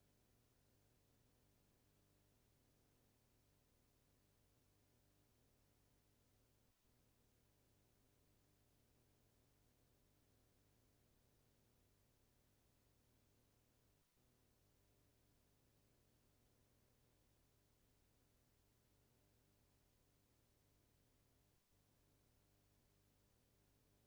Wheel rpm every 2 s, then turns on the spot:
0, 0, 0, 0, 0, 0, 0, 0, 0, 0, 0, 0.
none